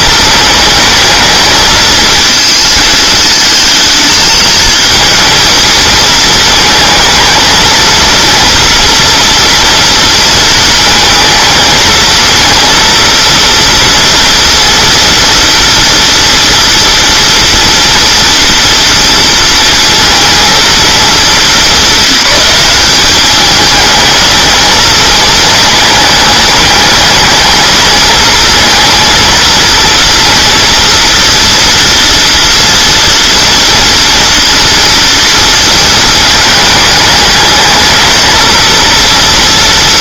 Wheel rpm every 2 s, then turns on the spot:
220, 220, 230, 220, 230, 230, 230, 230, 230, 230, 210, 190, 220, 210, 230, 240, 230, 230, 210, 230.
none